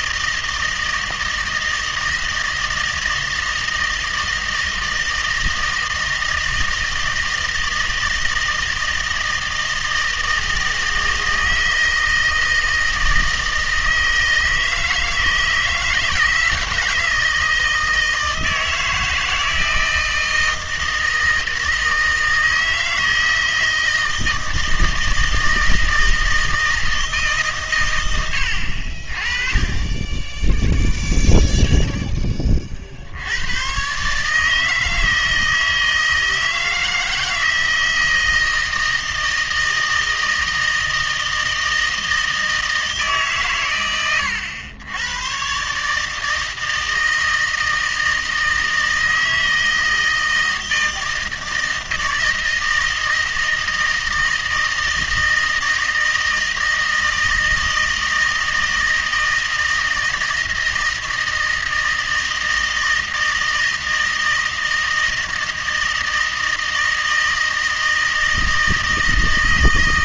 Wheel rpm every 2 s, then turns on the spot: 160, 160, 160, 160, 160, 160, 160, 160, 160, 160, 160, 160, 160, 160, 80, 10, 40, 160, 160, 160, 160, 160, 90, 160, 160, 160, 160, 160, 160, 160, 160, 160, 160, 160, 160.
none